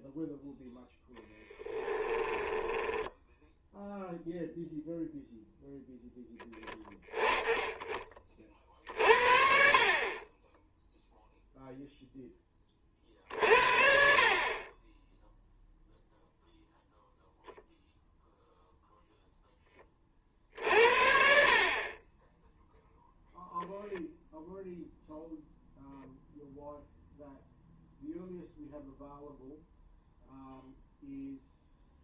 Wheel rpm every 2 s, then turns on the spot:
0, 10, 0, 10, 50, 0, 30, 20, 0, 0, 50, 0, 0, 0, 0, 0.
2-4